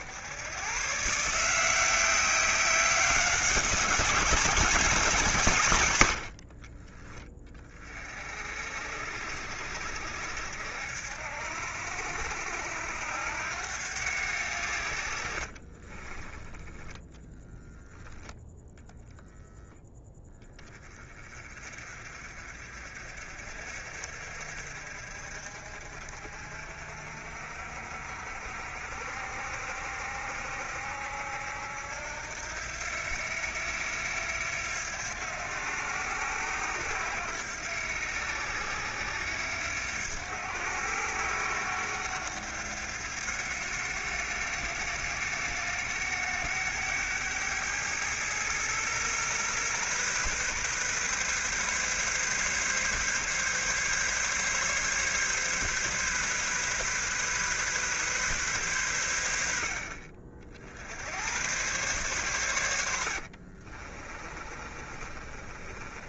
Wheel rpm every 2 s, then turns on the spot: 130, 190, 180, 30, 60, 70, 80, 70, 10, 0, 20, 50, 50, 50, 60, 70, 90, 90, 90, 90, 90, 90, 90, 100, 120, 130, 140, 140, 130, 100, 70, 90, 30.
6-8 62-66